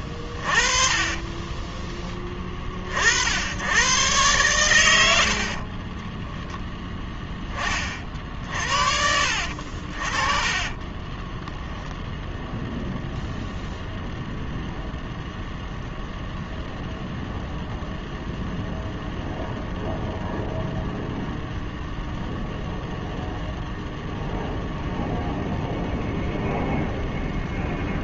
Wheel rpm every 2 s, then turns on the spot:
40, 50, 100, 0, 50, 20, 0, 0, 0, 0, 0, 0, 0, 0.
0-2 4-6 10-12